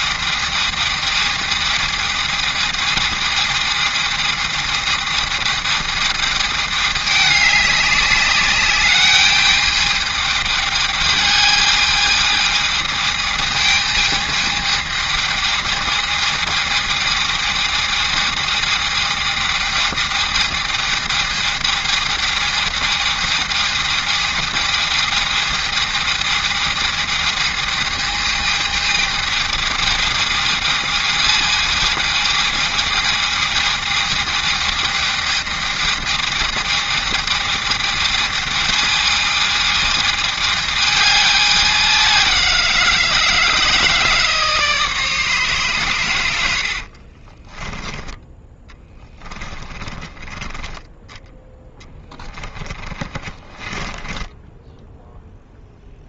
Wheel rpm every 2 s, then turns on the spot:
220, 210, 220, 200, 210, 210, 210, 220, 220, 220, 220, 220, 220, 220, 220, 220, 220, 220, 220, 220, 210, 160, 150, 40, 10, 10, 20, 0.
46-50 52-54